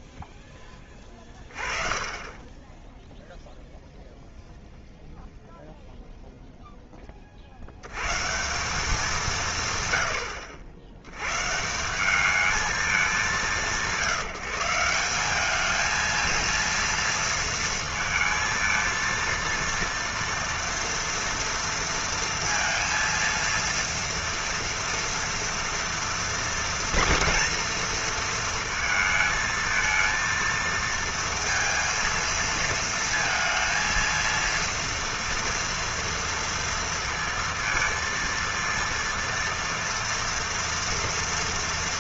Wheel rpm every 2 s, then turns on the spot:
10, 0, 0, 90, 140, 170, 160, 220, 220, 230, 230, 230, 230, 230, 220, 230, 230, 230, 230, 230, 230.
none